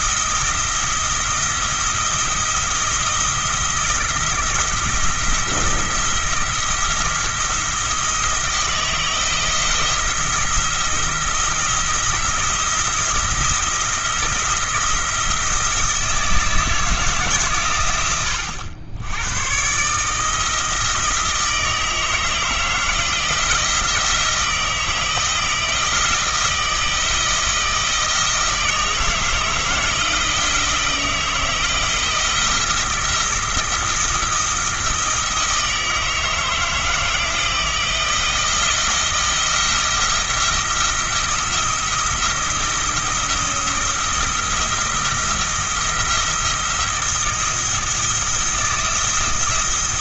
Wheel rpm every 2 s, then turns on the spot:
170, 170, 170, 170, 170, 170, 170, 170, 160, 100, 160, 160, 170, 170, 160, 160, 170, 160, 160, 170, 170, 160, 170, 170, 170.
none